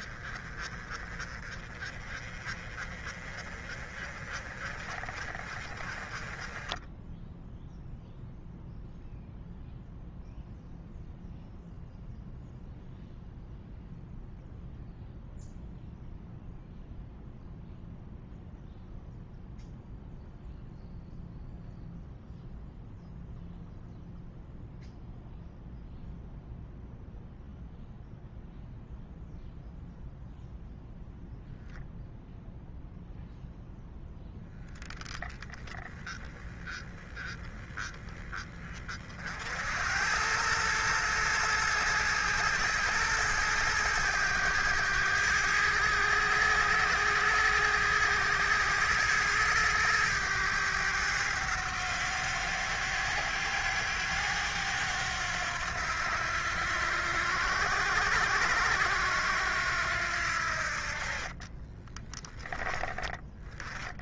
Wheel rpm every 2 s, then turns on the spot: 30, 30, 30, 10, 0, 0, 0, 0, 0, 0, 0, 0, 0, 0, 0, 0, 0, 10, 10, 30, 110, 110, 100, 110, 110, 100, 100, 90, 90, 90, 50, 10.
none